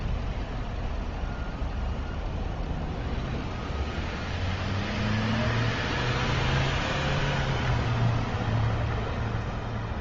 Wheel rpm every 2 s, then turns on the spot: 0, 0, 0, 0, 0.
none